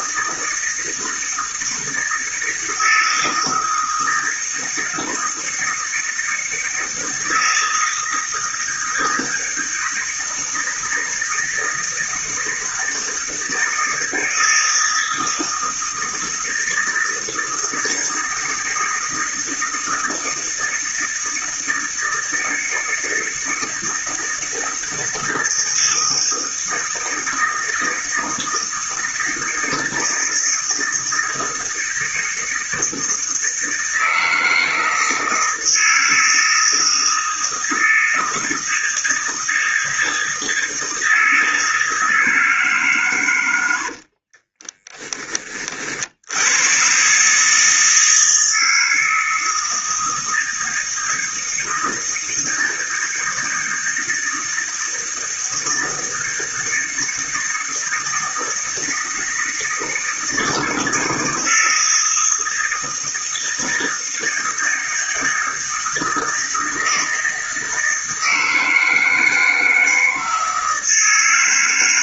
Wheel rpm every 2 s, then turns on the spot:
160, 160, 160, 160, 160, 160, 160, 160, 160, 160, 160, 160, 160, 160, 160, 160, 160, 160, 160, 160, 160, 130, 10, 120, 160, 160, 160, 160, 160, 160, 160, 160, 160, 160, 160, 160.
none